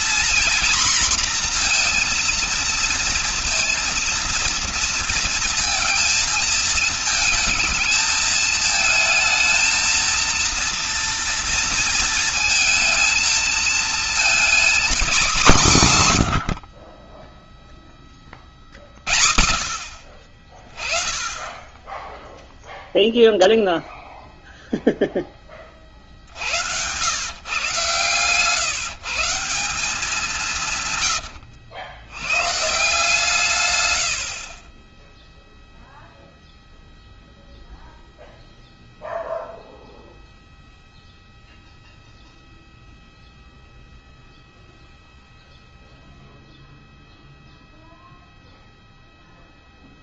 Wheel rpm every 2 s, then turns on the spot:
240, 230, 230, 220, 220, 230, 220, 240, 70, 30, 30, 0, 0, 70, 140, 150, 140, 40, 0, 0, 0, 0, 0, 0, 0.
none